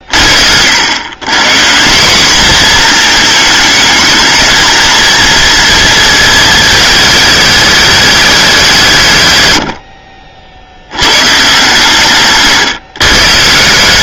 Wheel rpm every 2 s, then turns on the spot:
110, 230, 230, 210, 150, 100, 130.
none